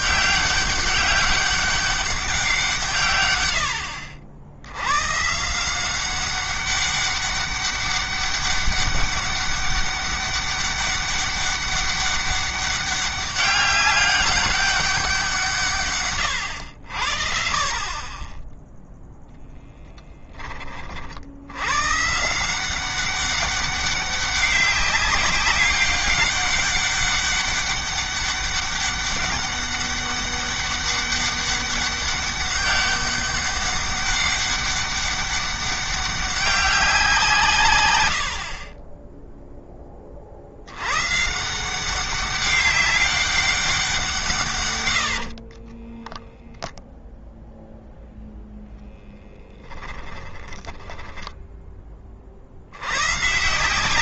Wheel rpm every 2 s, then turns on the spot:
200, 150, 100, 200, 200, 200, 200, 180, 70, 0, 40, 180, 200, 200, 200, 200, 200, 200, 180, 30, 110, 200, 100, 0, 10, 10, 90.
44-46 50-52